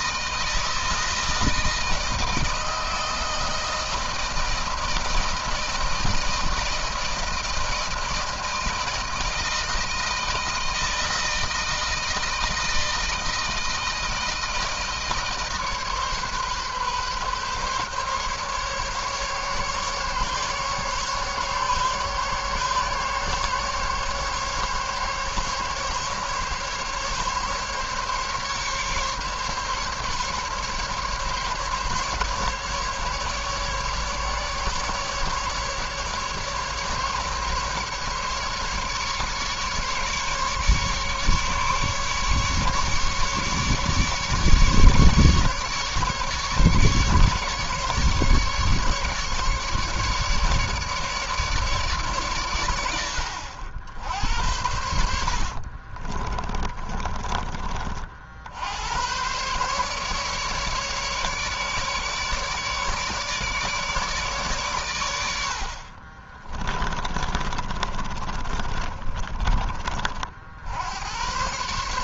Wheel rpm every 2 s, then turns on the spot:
160, 160, 160, 160, 160, 160, 160, 160, 140, 140, 140, 140, 140, 140, 140, 140, 140, 150, 150, 150, 150, 150, 150, 150, 150, 150, 110, 70, 20, 70, 150, 150, 130, 30, 30, 60.
54-58 66-70